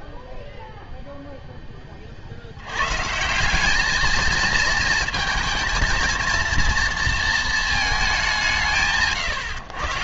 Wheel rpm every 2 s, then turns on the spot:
0, 70, 220, 230, 150.
none